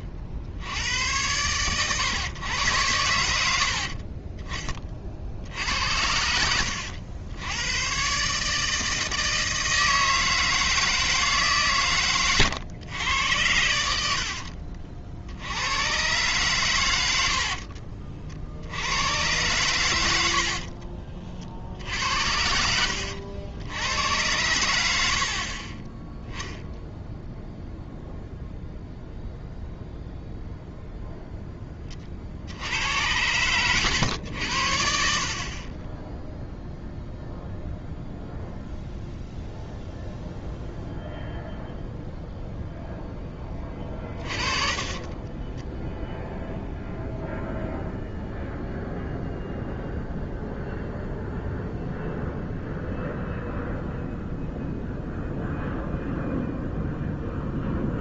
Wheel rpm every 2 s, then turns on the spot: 60, 100, 30, 80, 150, 160, 110, 60, 120, 80, 50, 80, 90, 0, 0, 0, 80, 80, 0, 0, 0, 0, 30, 0, 0, 0, 0, 0, 0.
6-8 14-16 20-24 44-46